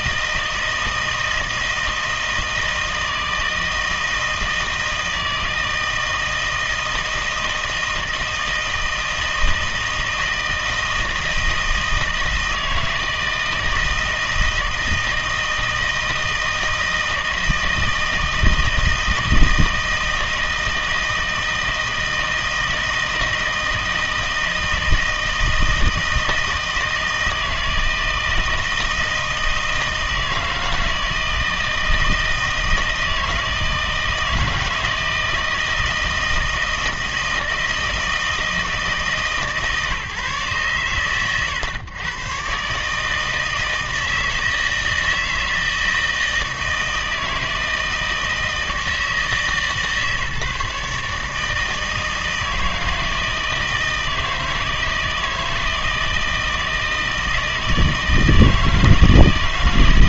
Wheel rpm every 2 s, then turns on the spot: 160, 160, 160, 160, 160, 160, 160, 160, 160, 160, 160, 160, 160, 160, 160, 160, 160, 160, 160, 160, 120, 140, 160, 160, 160, 150, 160, 160, 160, 160.
none